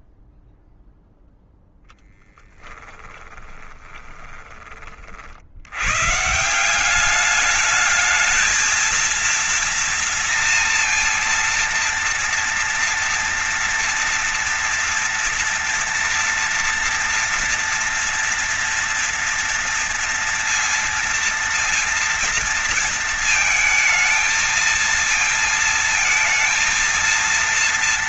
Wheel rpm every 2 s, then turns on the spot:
0, 20, 60, 190, 230, 230, 230, 230, 230, 230, 230, 230, 220, 230.
2-4